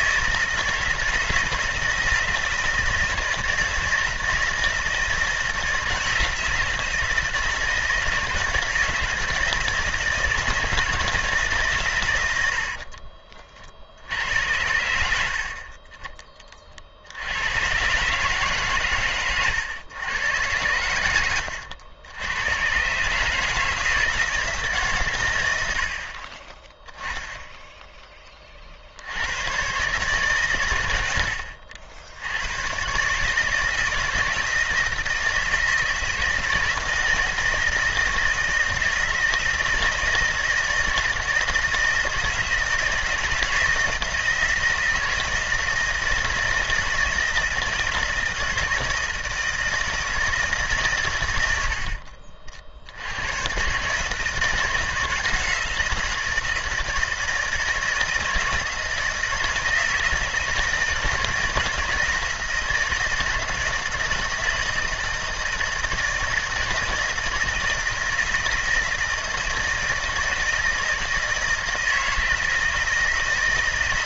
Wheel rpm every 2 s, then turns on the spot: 160, 160, 160, 160, 160, 160, 50, 90, 60, 120, 100, 130, 140, 10, 70, 100, 130, 160, 160, 160, 160, 160, 160, 160, 160, 130, 80, 160, 160, 160, 160, 160, 160, 160, 160, 160, 160.
12-14